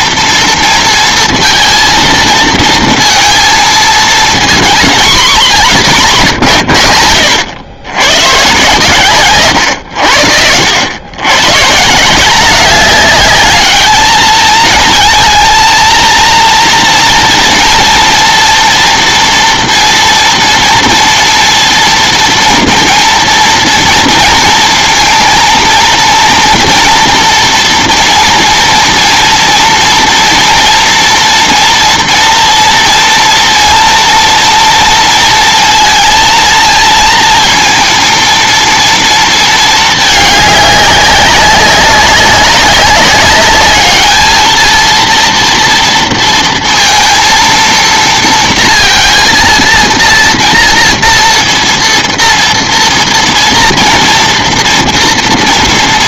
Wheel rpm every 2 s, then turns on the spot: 230, 230, 230, 110, 130, 90, 200, 220, 230, 230, 230, 230, 230, 230, 230, 230, 230, 230, 220, 230, 200, 200, 220, 230, 230, 230, 230, 240.
none